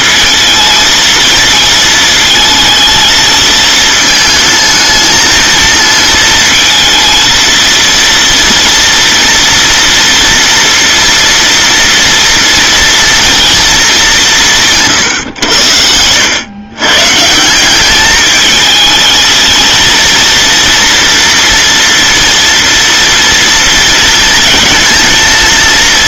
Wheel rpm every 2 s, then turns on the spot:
230, 220, 220, 230, 230, 230, 230, 160, 120, 220, 230, 230, 230.
none